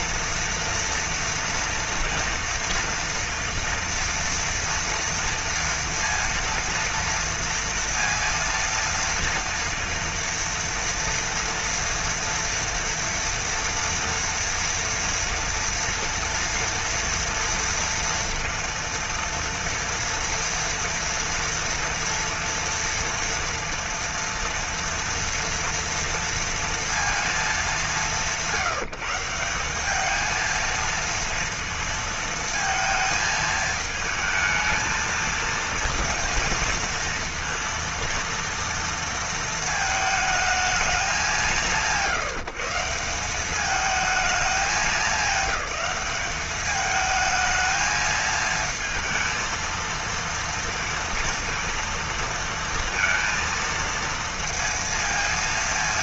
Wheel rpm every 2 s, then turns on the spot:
230, 230, 230, 240, 230, 230, 230, 230, 230, 230, 240, 230, 230, 230, 180, 220, 230, 220, 230, 230, 220, 160, 210, 200, 220, 230, 230, 230.
none